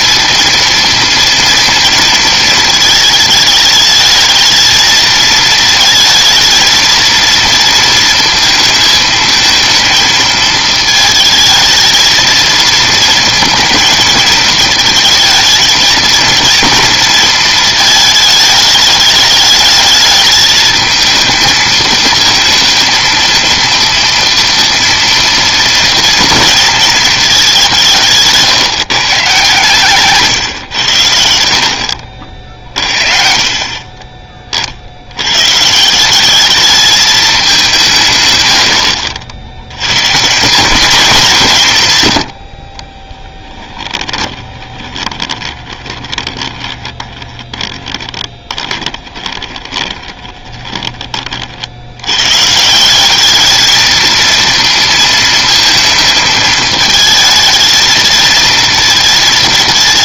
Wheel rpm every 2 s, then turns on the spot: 230, 220, 220, 230, 230, 220, 230, 220, 230, 210, 220, 230, 230, 230, 150, 110, 50, 50, 210, 90, 200, 50, 20, 20, 20, 20, 160, 230, 220, 230.
44-50